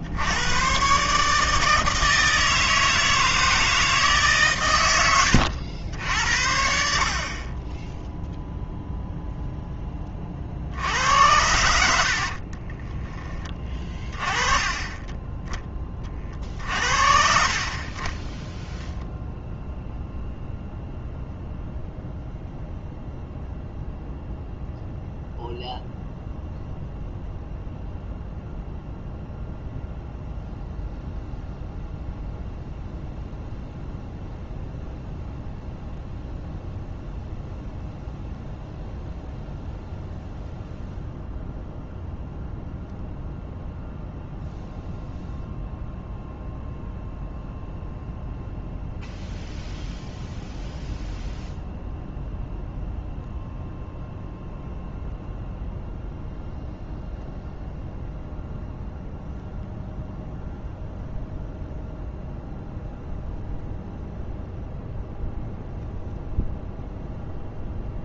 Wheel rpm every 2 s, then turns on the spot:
130, 160, 110, 60, 0, 70, 20, 20, 50, 0, 0, 0, 0, 0, 0, 0, 0, 0, 0, 0, 0, 0, 0, 0, 0, 0, 0, 0, 0, 0, 0, 0, 0, 0.
12-14